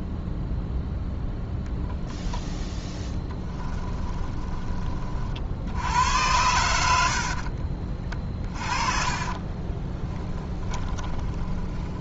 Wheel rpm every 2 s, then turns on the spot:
0, 0, 30, 80, 30, 20.
8-12